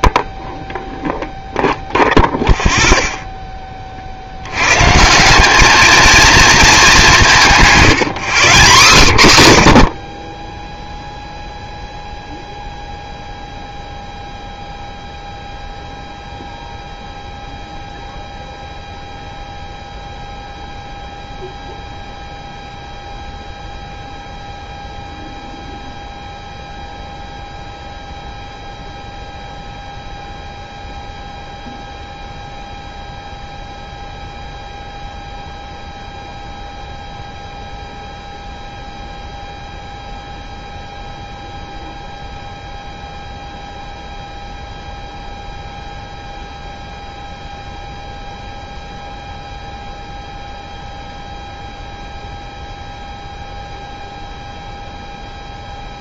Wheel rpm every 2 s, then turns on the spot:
0, 0, 130, 210, 80, 0, 0, 0, 0, 0, 0, 0, 0, 0, 0, 0, 0, 0, 0, 0, 0, 0, 0, 0, 0, 0, 0, 0.
none